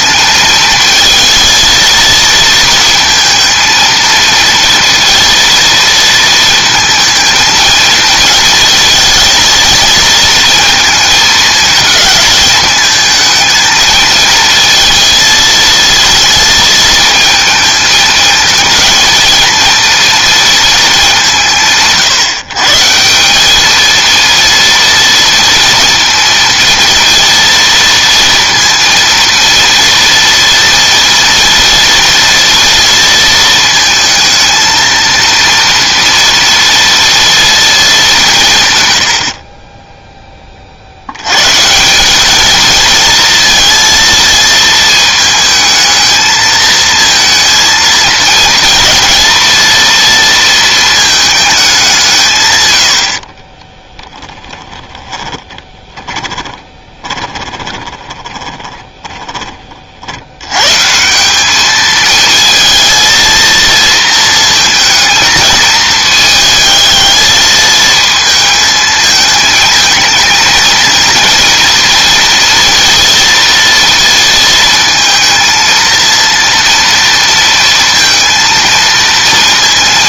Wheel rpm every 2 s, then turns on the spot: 230, 230, 230, 220, 230, 220, 220, 220, 230, 230, 220, 160, 230, 230, 230, 230, 230, 230, 230, 120, 60, 220, 220, 220, 230, 220, 100, 10, 20, 20, 130, 230, 230, 220, 220, 220, 240, 220, 230, 230.
54-60